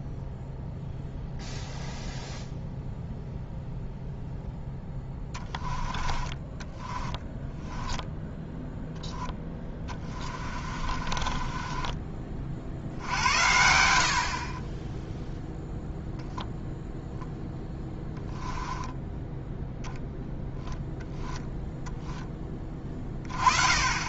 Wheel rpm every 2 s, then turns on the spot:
0, 0, 0, 10, 0, 40, 60, 20, 0, 10, 0, 30.
6-8 10-12 18-20